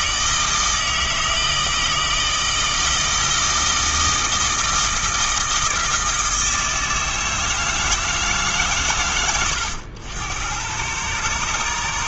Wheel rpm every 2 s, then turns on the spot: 160, 160, 160, 160, 150, 110.
none